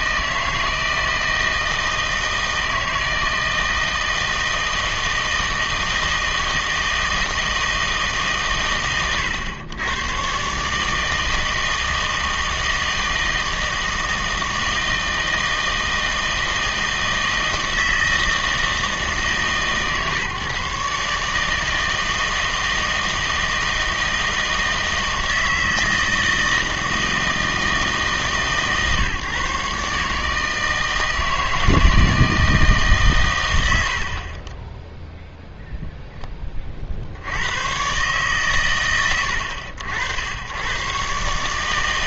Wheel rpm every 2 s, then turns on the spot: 160, 160, 160, 160, 120, 140, 160, 160, 160, 160, 150, 160, 160, 160, 140, 160, 160, 20, 30, 150, 100.
none